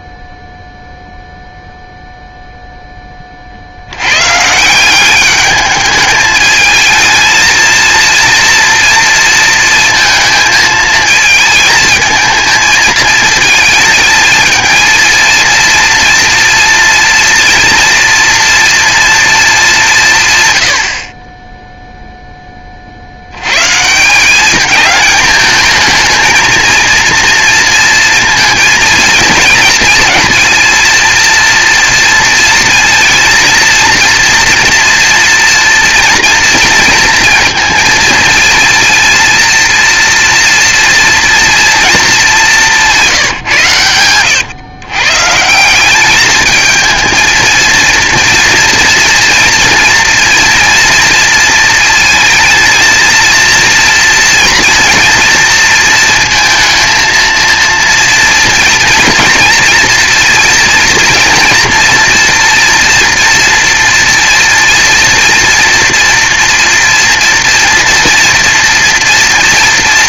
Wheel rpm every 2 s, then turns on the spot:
0, 130, 210, 230, 220, 220, 220, 230, 240, 130, 10, 180, 220, 230, 230, 230, 230, 230, 230, 230, 210, 110, 200, 230, 230, 230, 230, 230, 230, 230, 230, 230, 240, 240, 240.
42-44